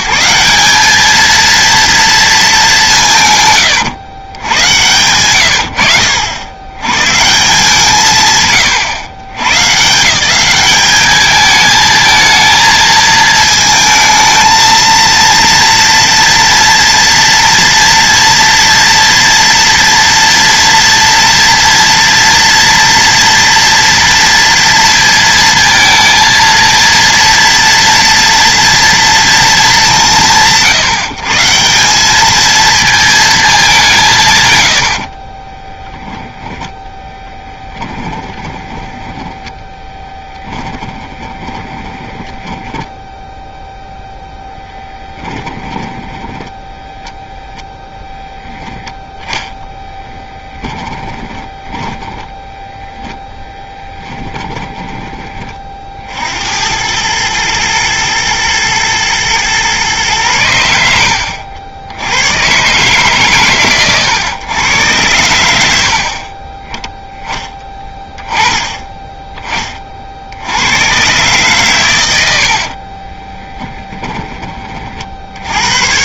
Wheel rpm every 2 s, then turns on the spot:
200, 200, 100, 110, 120, 200, 220, 220, 230, 230, 230, 230, 230, 230, 230, 160, 220, 120, 10, 10, 20, 10, 0, 10, 0, 10, 0, 20, 100, 120, 80, 140, 110, 10, 20, 120, 50, 30.
38-44 46-48 50-52 72-74